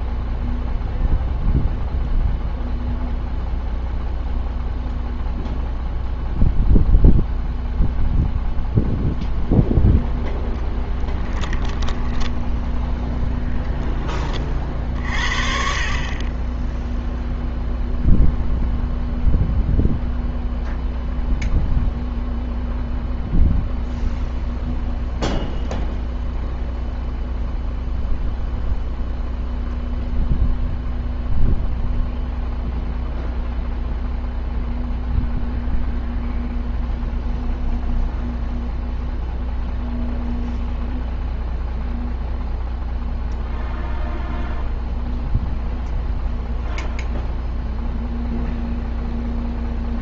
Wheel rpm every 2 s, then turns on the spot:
0, 0, 0, 0, 0, 10, 10, 50, 10, 0, 0, 0, 0, 0, 0, 0, 0, 0, 0, 0, 0, 0, 0, 0, 0.
10-14